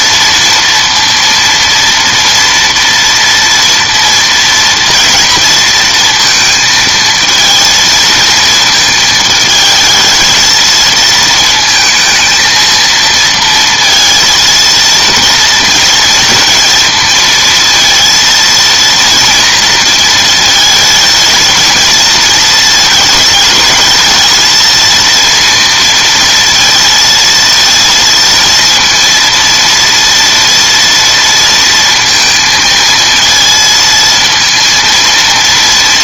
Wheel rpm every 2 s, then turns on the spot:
230, 230, 230, 230, 220, 230, 230, 230, 230, 230, 220, 220, 230, 230, 230, 230, 230, 230.
none